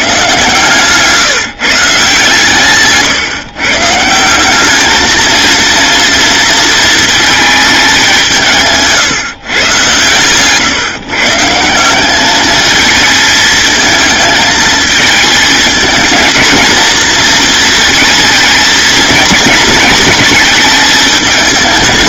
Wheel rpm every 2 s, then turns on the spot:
140, 140, 210, 230, 150, 140, 220, 220, 230, 220, 210.
none